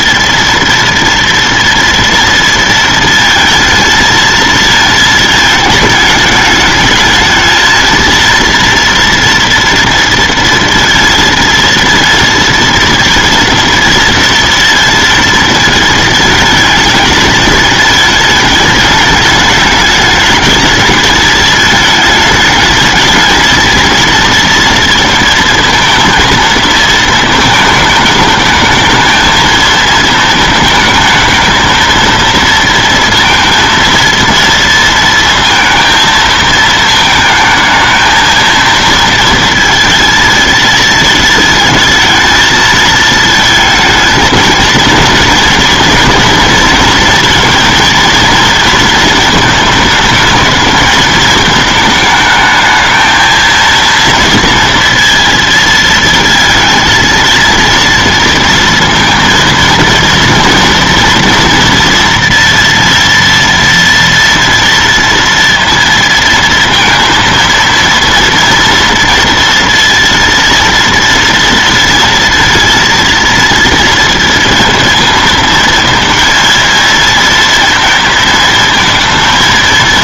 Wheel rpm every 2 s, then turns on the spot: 230, 230, 220, 220, 230, 230, 230, 230, 220, 210, 220, 220, 230, 230, 220, 220, 230, 230, 220, 220, 220, 220, 230, 230, 230, 220, 220, 230, 230, 230, 230, 240, 230, 230, 230, 230, 230, 230, 230, 230.
none